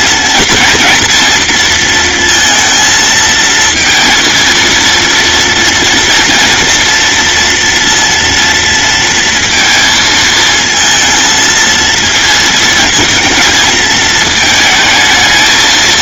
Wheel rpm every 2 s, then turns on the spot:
230, 230, 230, 240, 230, 220, 220, 220.
none